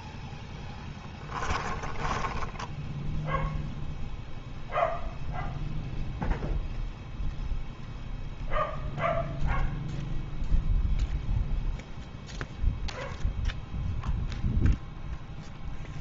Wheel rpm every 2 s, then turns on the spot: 0, 10, 0, 0, 0, 0, 0, 0.
none